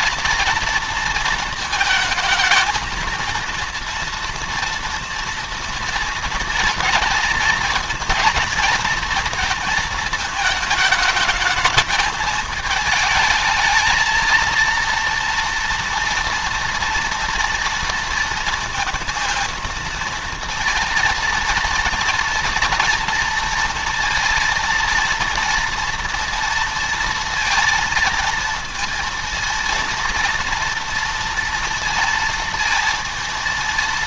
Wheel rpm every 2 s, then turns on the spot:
230, 230, 240, 230, 230, 220, 220, 230, 230, 230, 230, 230, 230, 230, 230, 230, 230.
none